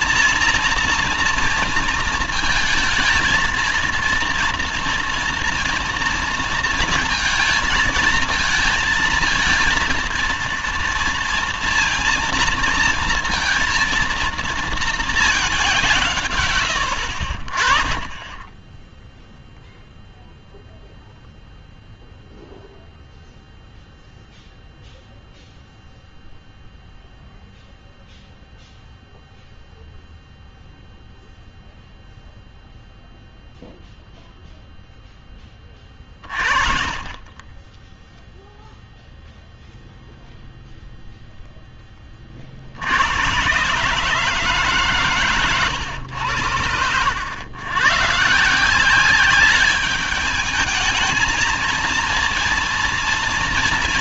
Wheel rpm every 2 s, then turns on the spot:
230, 220, 230, 230, 220, 230, 230, 220, 70, 0, 0, 0, 0, 0, 0, 0, 0, 10, 20, 0, 0, 120, 120, 100, 200, 230, 230.
none